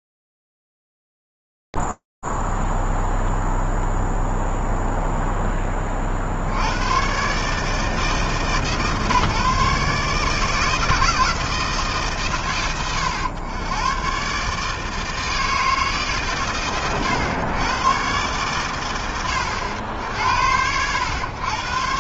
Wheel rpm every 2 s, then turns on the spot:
0, 0, 0, 90, 150, 160, 100, 140, 110, 120, 80.
none